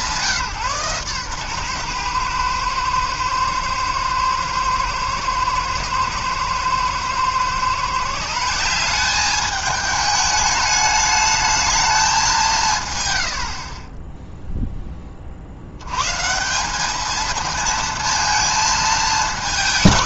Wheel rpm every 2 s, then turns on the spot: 140, 110, 110, 120, 190, 210, 160, 0, 190, 220.
none